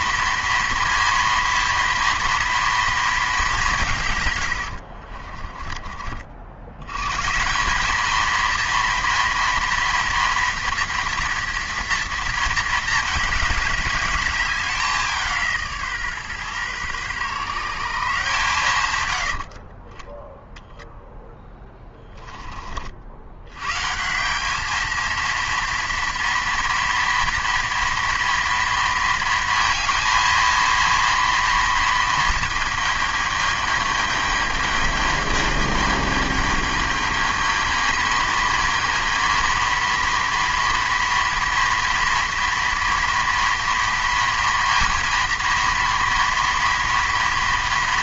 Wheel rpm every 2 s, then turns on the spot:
230, 230, 70, 80, 230, 230, 220, 190, 130, 140, 0, 50, 220, 230, 230, 230, 220, 210, 210, 220, 230, 230, 230, 230.
4-6